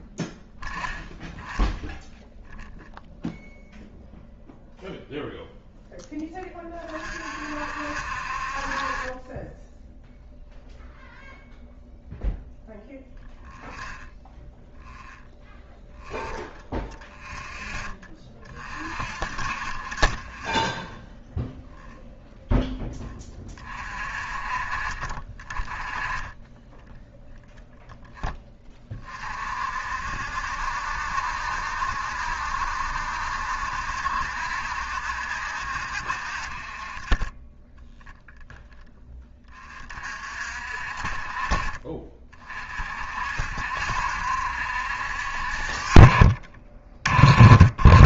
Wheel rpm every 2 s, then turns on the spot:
10, 0, 0, 20, 40, 0, 0, 0, 0, 30, 10, 10, 30, 10, 30, 70, 70, 70, 40, 0, 50, 50, 70, 30.
none